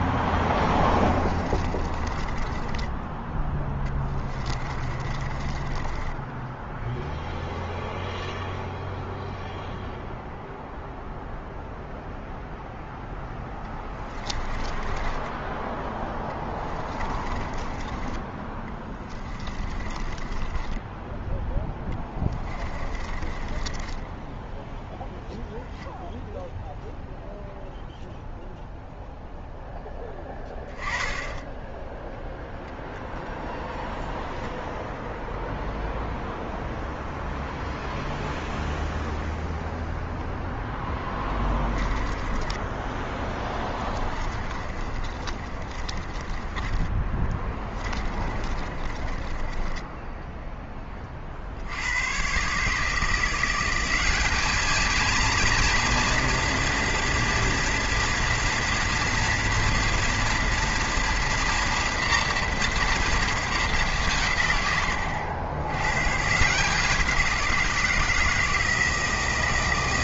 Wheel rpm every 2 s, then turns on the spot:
10, 20, 20, 10, 0, 0, 0, 20, 30, 10, 20, 20, 0, 0, 0, 10, 0, 0, 0, 0, 0, 10, 30, 20, 30, 10, 140, 220, 240, 230, 230, 230, 120, 180, 170.
0-8 14-24 44-46 48-50